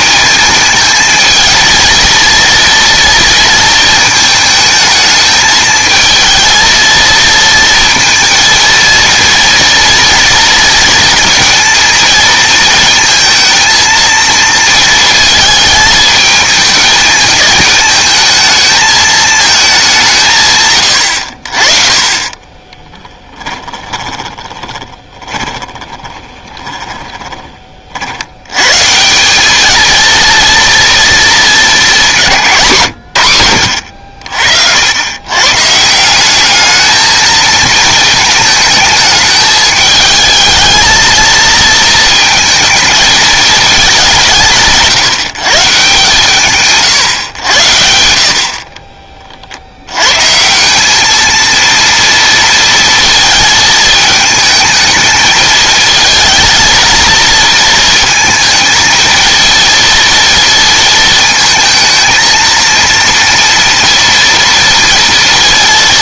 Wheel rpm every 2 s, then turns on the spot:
220, 230, 220, 230, 230, 230, 230, 220, 220, 220, 120, 20, 30, 20, 130, 230, 140, 70, 210, 220, 220, 220, 170, 140, 40, 190, 230, 220, 230, 220, 230, 230, 230.
22-28 48-50